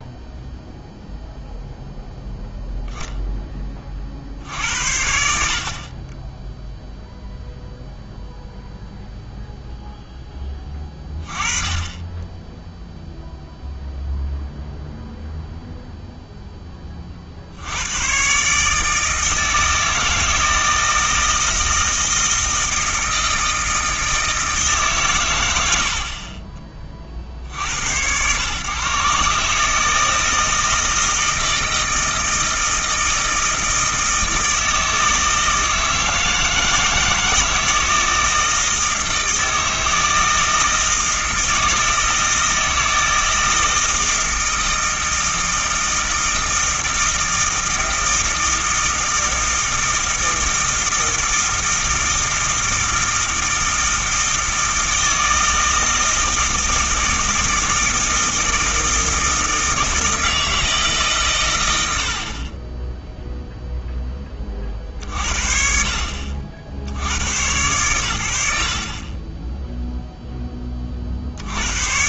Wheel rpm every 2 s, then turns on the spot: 0, 0, 80, 0, 0, 20, 0, 0, 20, 150, 160, 160, 150, 30, 130, 160, 160, 160, 160, 160, 160, 160, 160, 160, 160, 160, 160, 160, 160, 160, 160, 20, 30, 60, 50, 20.
none